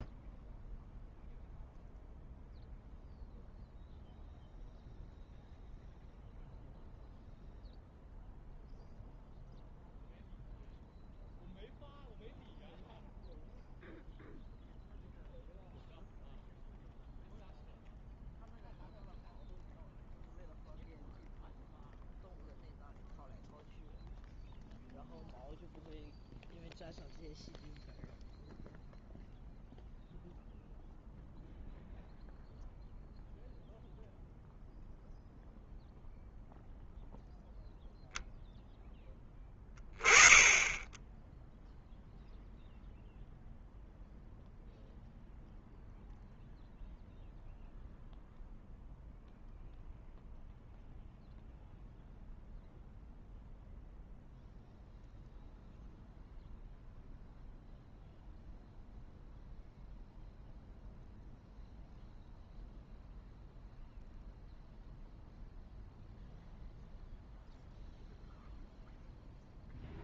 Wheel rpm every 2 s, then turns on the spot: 0, 0, 0, 0, 0, 0, 0, 0, 0, 0, 0, 0, 0, 0, 0, 0, 0, 0, 0, 10, 10, 0, 0, 0, 0, 0, 0, 0, 0, 0, 0, 0, 0, 0, 0.
none